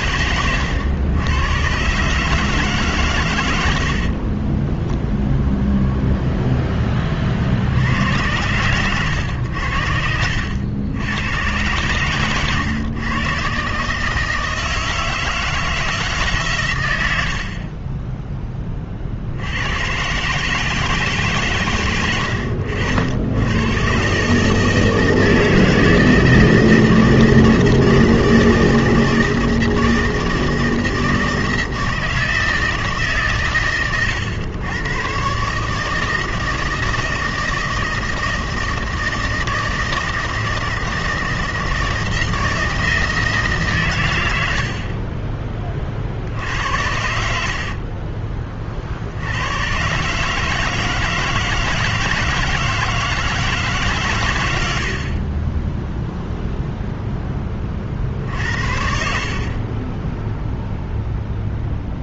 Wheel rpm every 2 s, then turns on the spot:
110, 150, 20, 10, 110, 80, 120, 160, 120, 20, 150, 80, 150, 160, 160, 160, 160, 100, 160, 160, 160, 160, 70, 80, 40, 160, 160, 100, 0, 60, 0.
4-6 58-60